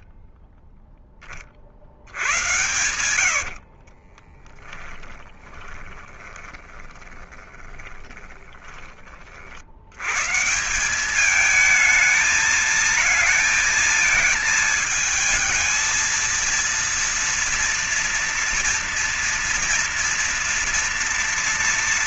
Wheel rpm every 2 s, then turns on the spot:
10, 100, 20, 20, 40, 200, 220, 220, 230, 230, 230.
2-8